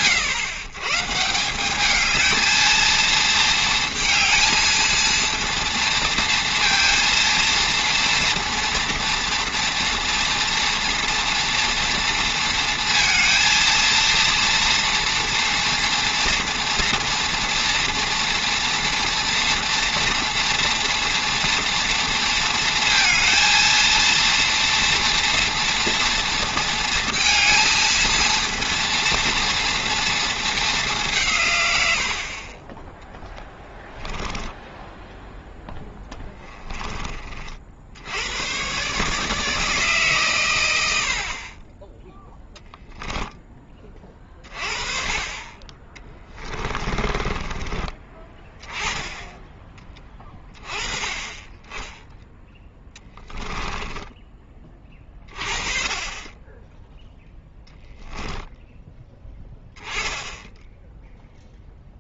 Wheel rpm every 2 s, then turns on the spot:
130, 230, 230, 230, 230, 230, 230, 230, 230, 230, 230, 230, 230, 230, 230, 210, 10, 0, 20, 140, 100, 0, 30, 20, 10, 20, 10, 30, 10, 10, 10.
46-48 52-54